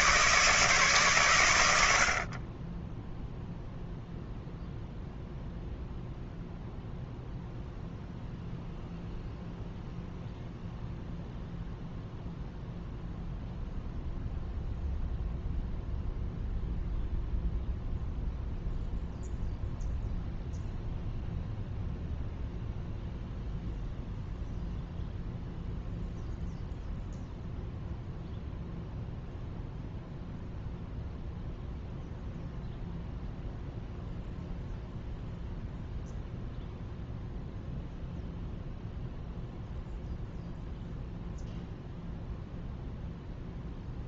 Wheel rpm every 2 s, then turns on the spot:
140, 20, 0, 0, 0, 0, 0, 0, 0, 0, 0, 0, 0, 0, 0, 0, 0, 0, 0, 0, 0, 0.
none